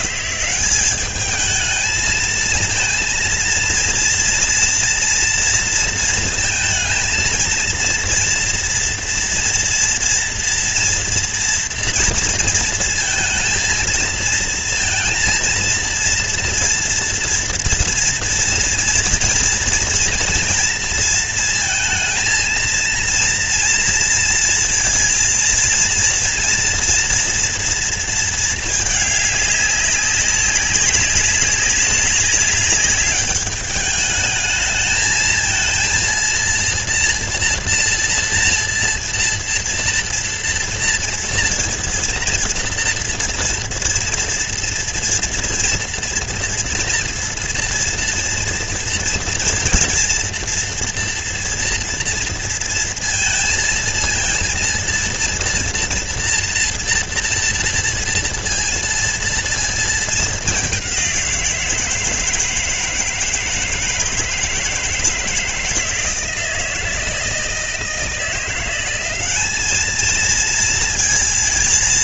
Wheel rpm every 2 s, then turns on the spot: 180, 220, 230, 230, 230, 230, 230, 230, 230, 230, 230, 230, 230, 230, 230, 200, 200, 210, 230, 230, 230, 230, 230, 240, 230, 230, 230, 230, 240, 230, 210, 160, 160, 160, 170, 220.
none